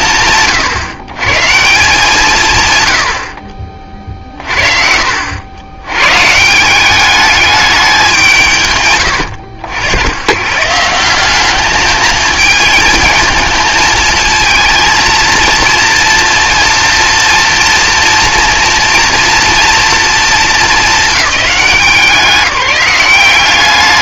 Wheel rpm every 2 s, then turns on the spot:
130, 60, 60, 200, 110, 180, 230, 230, 230, 230, 210, 190.
none